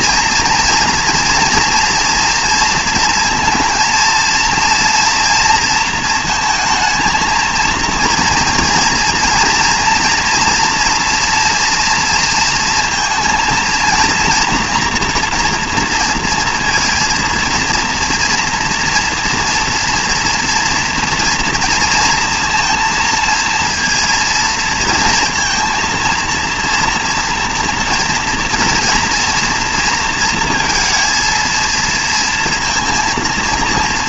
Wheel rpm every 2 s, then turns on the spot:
230, 230, 230, 230, 230, 230, 230, 230, 230, 230, 230, 230, 230, 230, 230, 230, 230.
none